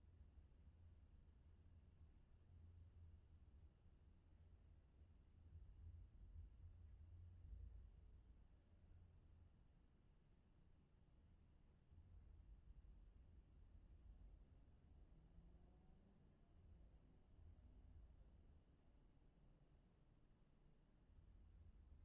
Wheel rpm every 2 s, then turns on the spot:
0, 0, 0, 0, 0, 0, 0, 0, 0, 0, 0.
none